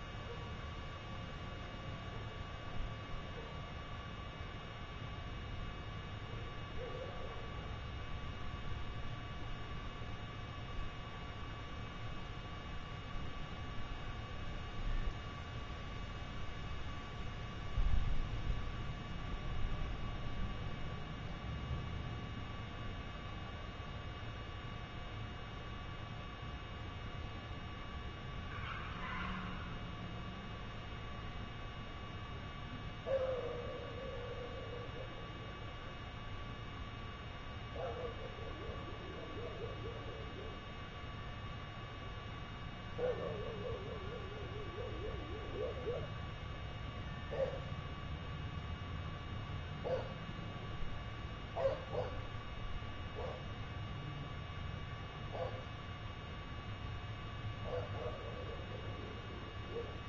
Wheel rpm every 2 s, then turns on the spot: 0, 0, 0, 0, 0, 0, 0, 0, 0, 0, 0, 0, 0, 0, 0, 0, 0, 0, 0, 0, 0, 0, 0, 0, 0, 0, 0, 0, 0, 0.
none